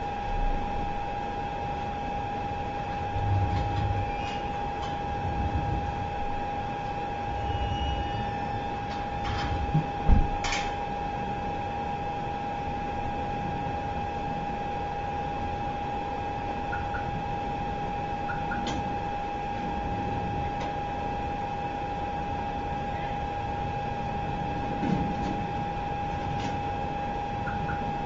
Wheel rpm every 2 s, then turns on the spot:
0, 0, 0, 0, 0, 0, 0, 0, 0, 0, 0, 0, 0, 0.
none